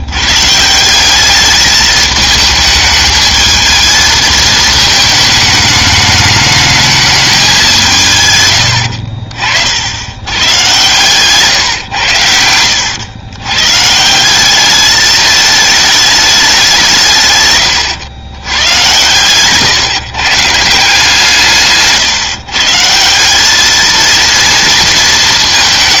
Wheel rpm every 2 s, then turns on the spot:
160, 220, 220, 220, 100, 120, 90, 200, 190, 110, 160, 150, 230.
8-10 12-14